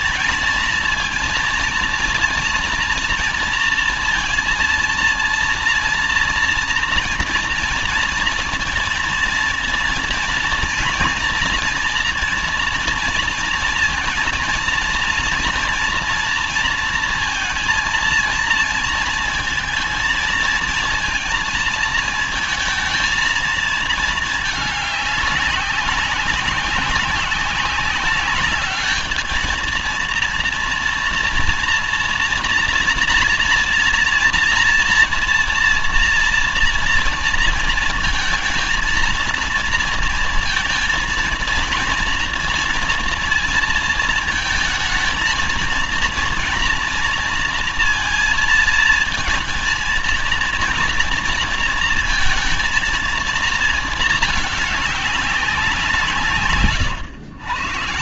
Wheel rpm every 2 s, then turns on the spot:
220, 230, 230, 230, 230, 230, 230, 230, 230, 220, 230, 230, 210, 190, 210, 230, 240, 230, 230, 230, 230, 230, 220, 230, 220, 230, 230, 210, 130.
none